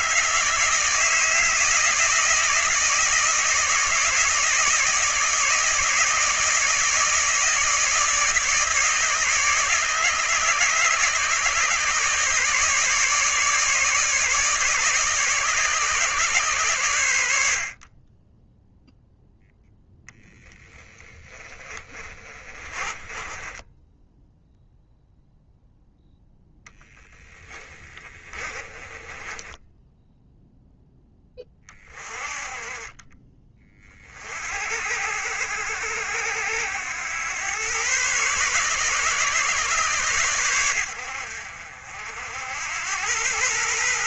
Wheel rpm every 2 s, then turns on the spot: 160, 160, 160, 160, 160, 150, 150, 150, 110, 0, 10, 30, 0, 10, 20, 10, 30, 70, 90, 140, 90, 100.
22-24 26-30